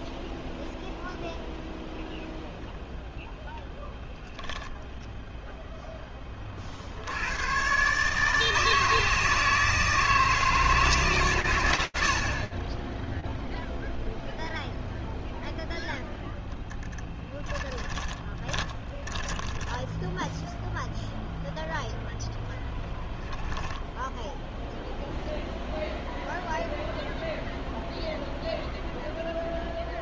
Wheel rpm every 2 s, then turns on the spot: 0, 0, 0, 100, 160, 150, 0, 0, 10, 20, 0, 10, 0, 0, 0.
16-20